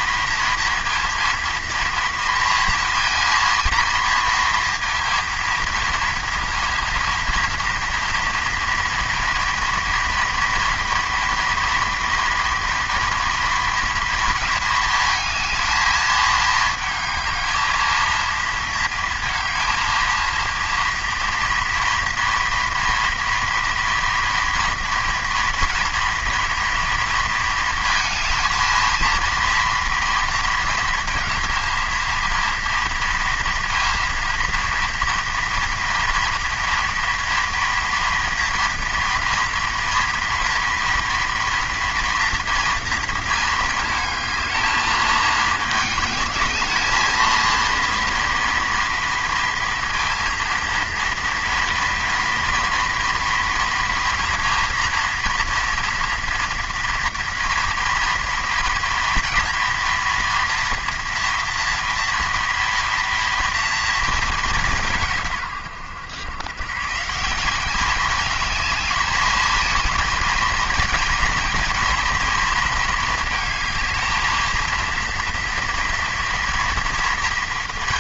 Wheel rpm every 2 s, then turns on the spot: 230, 230, 230, 230, 230, 230, 230, 230, 220, 230, 230, 230, 240, 230, 220, 230, 230, 230, 230, 230, 230, 230, 220, 210, 230, 230, 230, 230, 240, 230, 230, 230, 210, 110, 210, 220, 230, 220, 230.
none